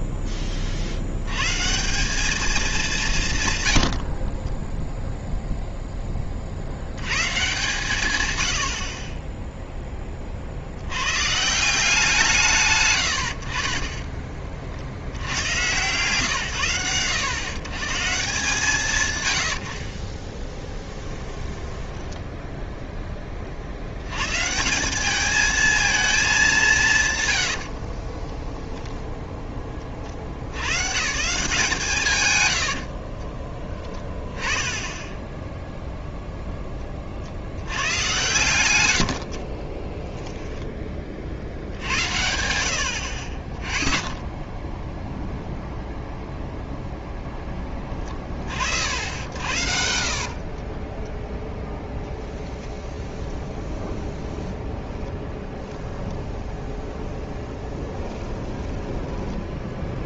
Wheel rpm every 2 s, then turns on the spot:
50, 200, 10, 70, 70, 80, 120, 60, 110, 150, 20, 10, 180, 170, 10, 110, 80, 10, 20, 110, 20, 70, 10, 0, 60, 30, 20, 0, 0, 10.
20-22 28-30 32-34 50-52 58-60